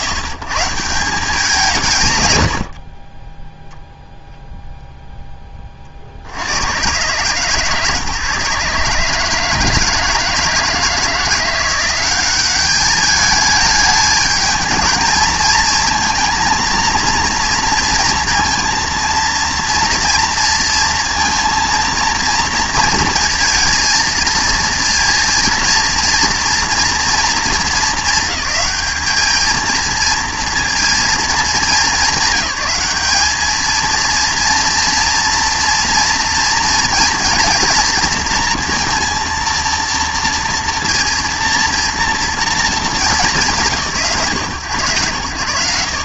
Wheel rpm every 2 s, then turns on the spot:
120, 110, 0, 100, 150, 160, 200, 220, 230, 230, 230, 230, 230, 240, 210, 230, 210, 240, 240, 230, 230, 220, 120.
none